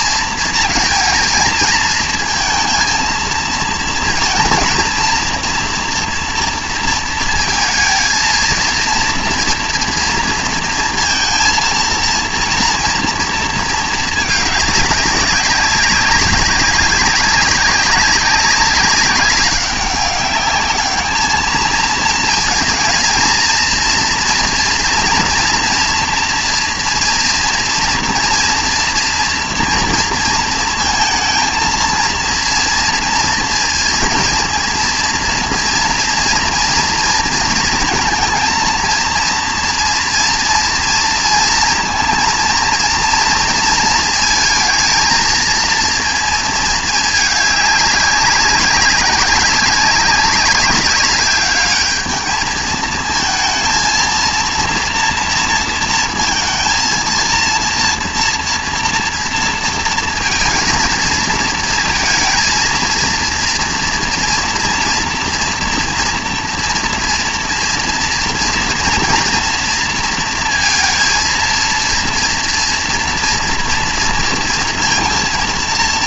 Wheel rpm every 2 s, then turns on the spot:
220, 230, 230, 230, 230, 230, 230, 210, 190, 190, 210, 230, 230, 230, 240, 230, 230, 230, 230, 230, 230, 230, 220, 220, 200, 200, 220, 230, 230, 230, 230, 230, 230, 230, 230, 230, 230, 230.
none